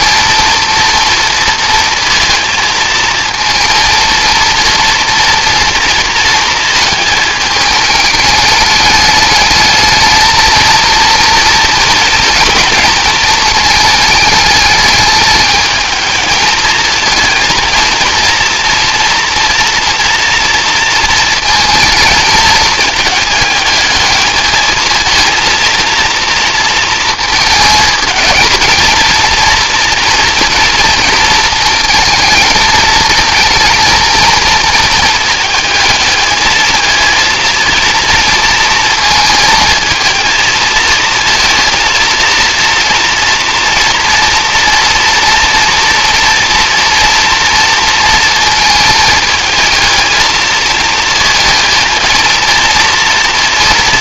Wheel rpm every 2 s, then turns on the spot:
230, 230, 230, 230, 210, 220, 230, 210, 220, 220, 230, 220, 210, 230, 220, 230, 220, 230, 220, 230, 230, 230, 230, 230, 230, 220, 220.
none